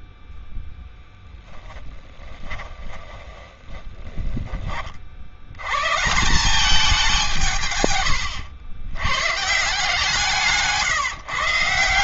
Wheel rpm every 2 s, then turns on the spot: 0, 10, 20, 200, 90, 160.
2-4 10-12